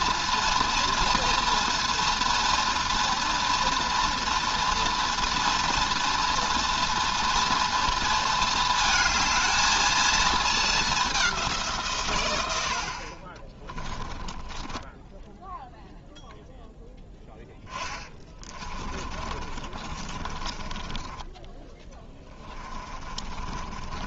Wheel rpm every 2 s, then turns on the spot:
230, 230, 230, 240, 220, 220, 90, 10, 0, 20, 20, 20.
14-16 18-24